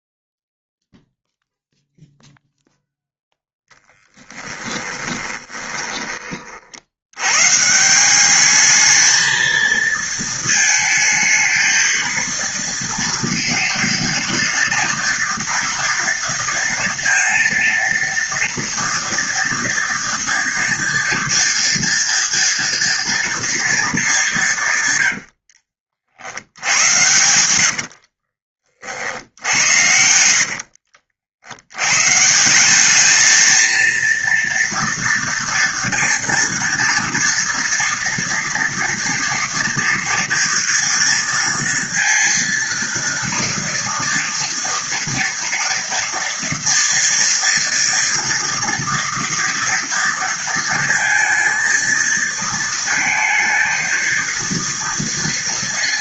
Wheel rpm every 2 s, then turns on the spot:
0, 0, 10, 50, 210, 220, 230, 230, 230, 230, 230, 230, 160, 80, 40, 70, 180, 230, 230, 230, 230, 230, 230, 230, 230, 230, 230, 230.
4-6 30-32